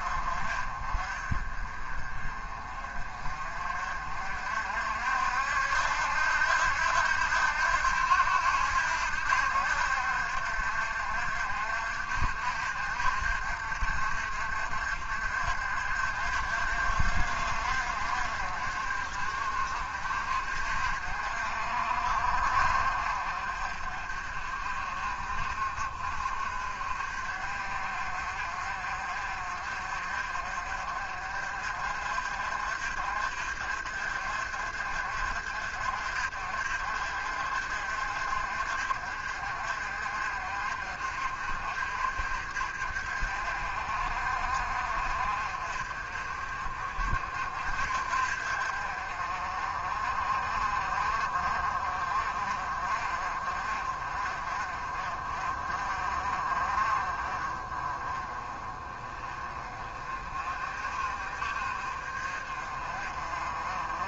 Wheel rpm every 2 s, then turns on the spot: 40, 40, 60, 80, 80, 60, 60, 60, 60, 50, 50, 50, 50, 50, 50, 50, 50, 50, 50, 50, 50, 50, 50, 50, 50, 40, 40, 40, 40, 30, 40, 40.
none